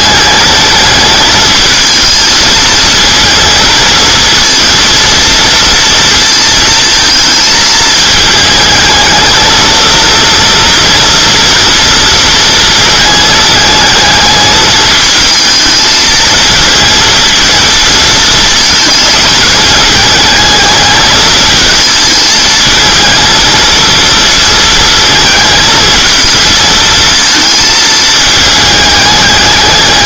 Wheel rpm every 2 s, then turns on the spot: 210, 220, 230, 230, 220, 230, 230, 220, 230, 220, 210, 220, 220, 230, 220.
none